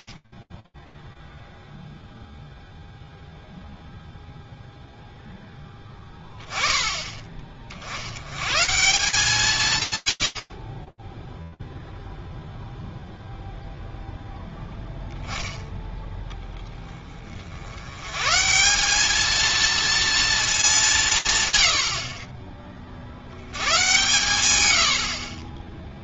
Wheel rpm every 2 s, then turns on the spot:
60, 0, 0, 20, 180, 40, 0, 10, 10, 160, 210, 40, 90.
none